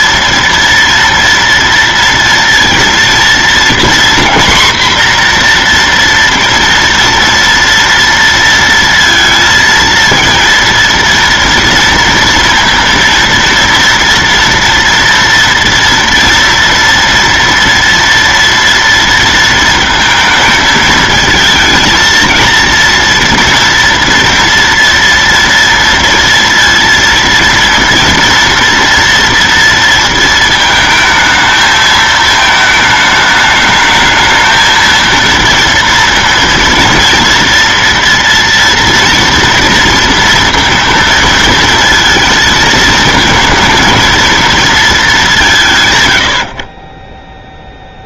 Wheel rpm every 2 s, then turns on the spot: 230, 230, 240, 240, 230, 230, 230, 230, 230, 230, 220, 230, 230, 230, 230, 220, 220, 220, 230, 230, 230, 220, 220, 110.
none